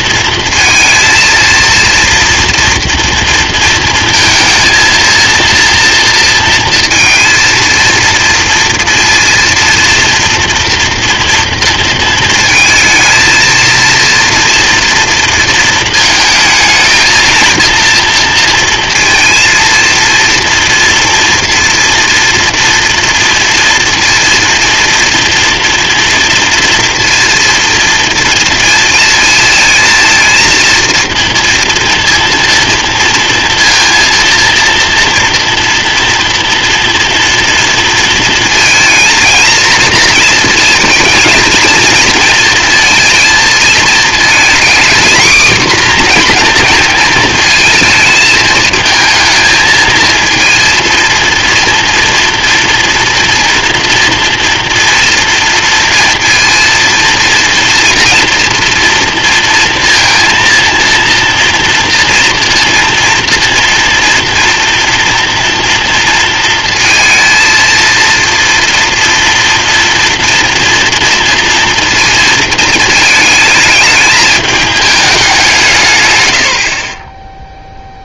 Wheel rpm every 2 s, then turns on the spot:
230, 230, 220, 230, 230, 230, 220, 230, 220, 230, 230, 230, 240, 230, 230, 230, 230, 230, 230, 230, 220, 230, 230, 240, 220, 230, 230, 230, 230, 230, 230, 230, 230, 230, 230, 240, 220, 210, 80.
none